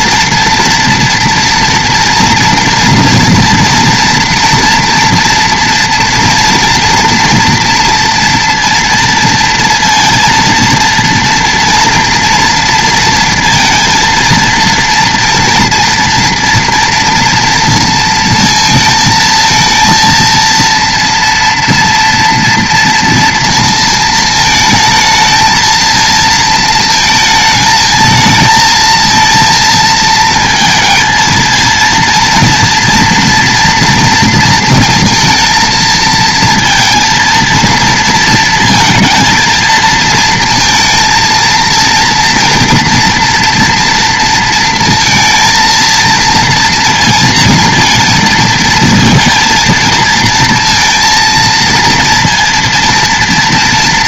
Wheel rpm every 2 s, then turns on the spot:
230, 230, 230, 230, 230, 230, 230, 230, 230, 230, 230, 230, 220, 220, 230, 230, 230, 230, 230, 230, 230, 240, 230, 230, 230, 230, 230.
none